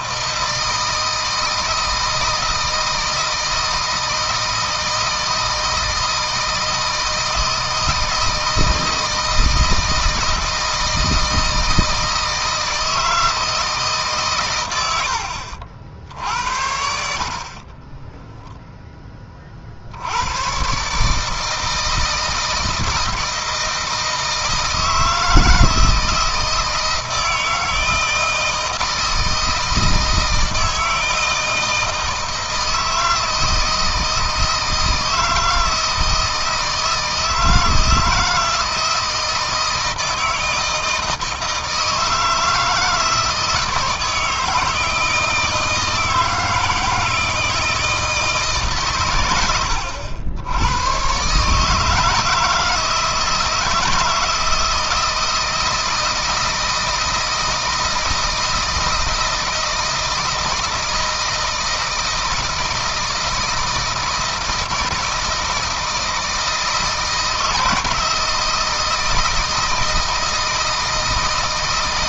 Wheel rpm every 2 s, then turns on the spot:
160, 160, 160, 160, 160, 160, 160, 100, 50, 20, 140, 160, 160, 160, 160, 160, 160, 160, 160, 160, 160, 160, 160, 160, 130, 110, 160, 160, 160, 160, 160, 160, 160, 160, 170, 160.
14-16